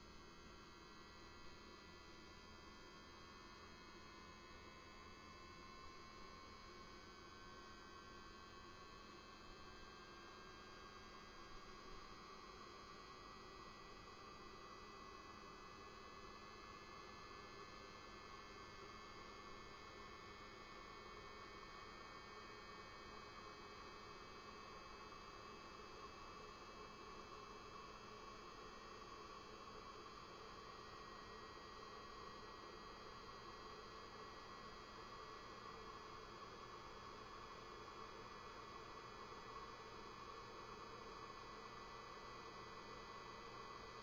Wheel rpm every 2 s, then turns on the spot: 0, 0, 0, 0, 0, 0, 0, 0, 0, 0, 0, 0, 0, 0, 0, 0, 0, 0, 0, 0, 0, 0.
none